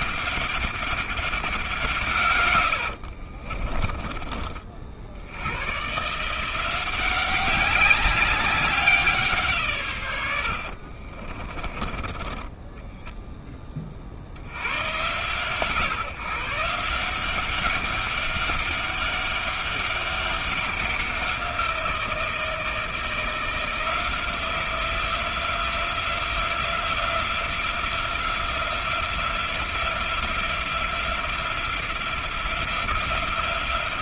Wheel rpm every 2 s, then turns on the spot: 190, 60, 90, 190, 160, 30, 10, 120, 180, 200, 180, 170, 180, 180, 180, 180, 180.
2-4 10-12